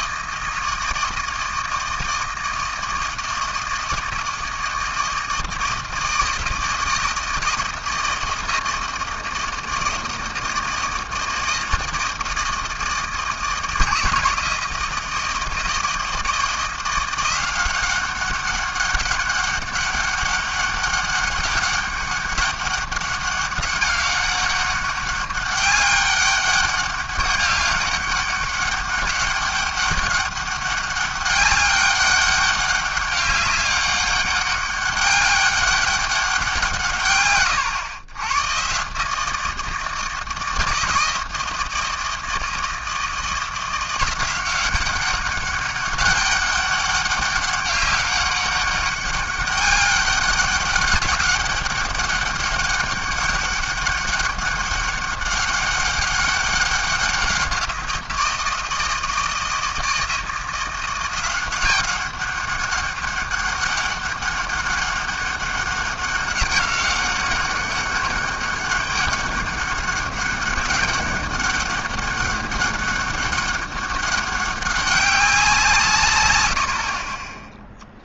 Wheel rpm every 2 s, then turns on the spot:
160, 160, 160, 160, 160, 160, 160, 160, 170, 200, 200, 200, 200, 200, 200, 200, 200, 200, 160, 130, 160, 160, 190, 200, 200, 200, 200, 200, 200, 160, 170, 190, 200, 200, 200, 200, 200, 200, 90.
none